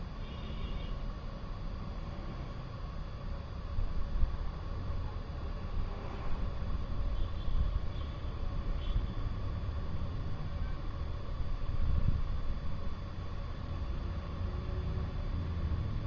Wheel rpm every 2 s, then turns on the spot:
0, 0, 0, 0, 0, 0, 0, 0.
none